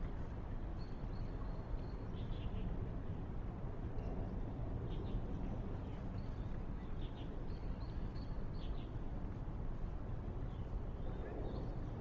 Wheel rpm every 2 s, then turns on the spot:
0, 0, 0, 0, 0, 0.
none